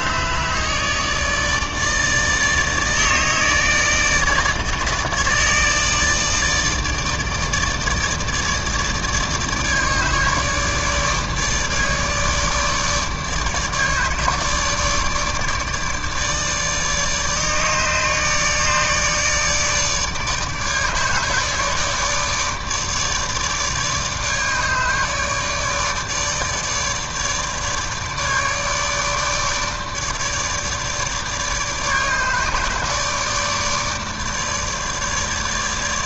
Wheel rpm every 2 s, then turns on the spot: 150, 150, 150, 150, 150, 150, 150, 150, 150, 150, 150, 150, 150, 150, 150, 150, 150, 150.
none